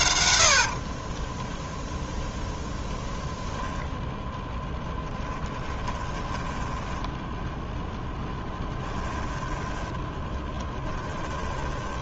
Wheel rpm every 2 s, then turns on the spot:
0, 10, 20, 0, 10, 10.
2-6 8-12